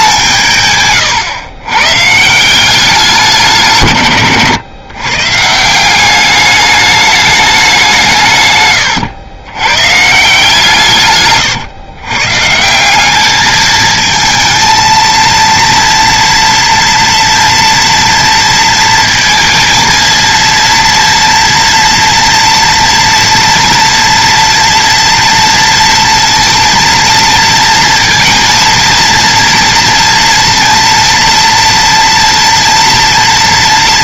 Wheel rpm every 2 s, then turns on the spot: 140, 190, 120, 210, 120, 150, 170, 220, 230, 230, 230, 230, 230, 230, 230, 230, 230.
0-2